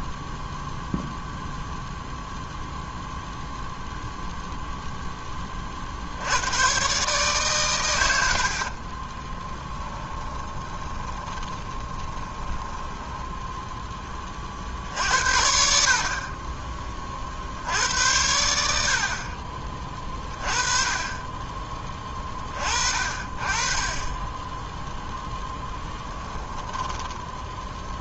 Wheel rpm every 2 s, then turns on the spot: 0, 0, 0, 120, 60, 20, 20, 50, 30, 80, 30, 30, 10, 10.
8-14 26-28